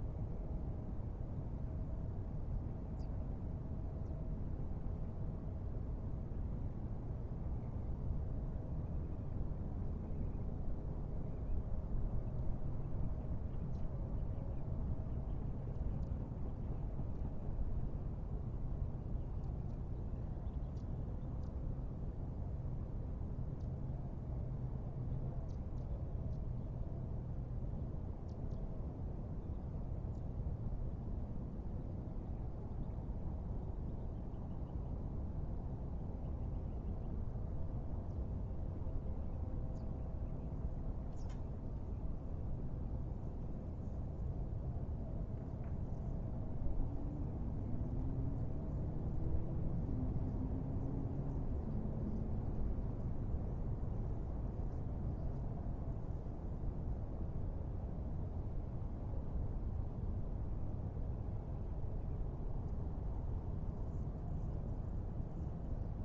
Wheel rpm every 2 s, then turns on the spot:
0, 0, 0, 0, 0, 0, 0, 0, 0, 0, 0, 0, 0, 0, 0, 0, 0, 0, 0, 0, 0, 0, 0, 0, 0, 0, 0, 0, 0, 0, 0, 0, 0.
none